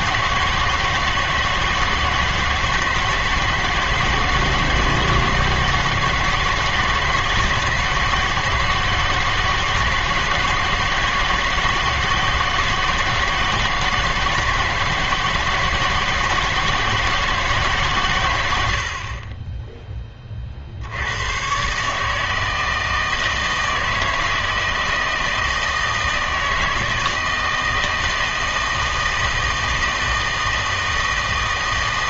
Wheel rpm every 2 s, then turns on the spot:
160, 160, 160, 160, 160, 160, 160, 160, 160, 70, 70, 160, 160, 160, 160, 160.
none